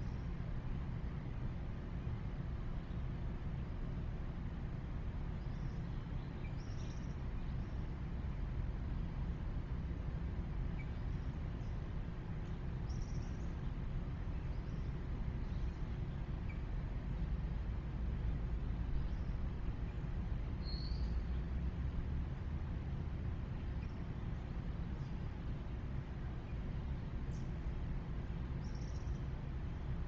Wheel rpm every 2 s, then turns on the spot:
0, 0, 0, 0, 0, 0, 0, 0, 0, 0, 0, 0, 0, 0, 0.
none